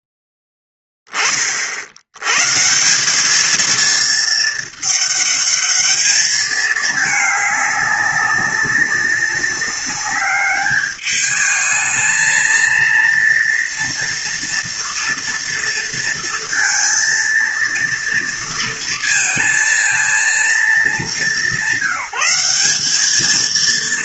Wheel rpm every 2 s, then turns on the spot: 30, 220, 210, 210, 190, 210, 230, 230, 230, 230, 200, 220.
none